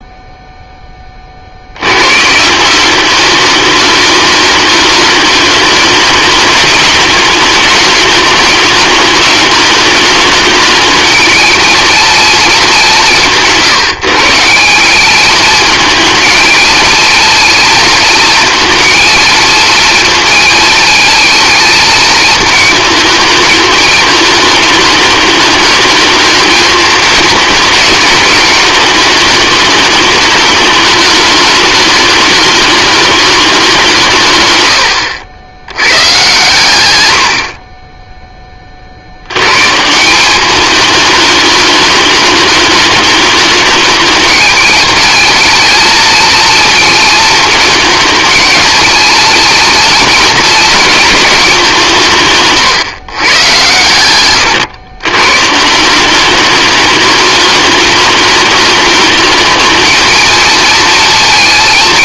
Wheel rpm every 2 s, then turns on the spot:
20, 190, 210, 210, 210, 220, 200, 200, 220, 230, 220, 220, 210, 220, 210, 210, 210, 100, 110, 60, 210, 210, 210, 230, 220, 220, 130, 110, 210, 210, 230.
34-36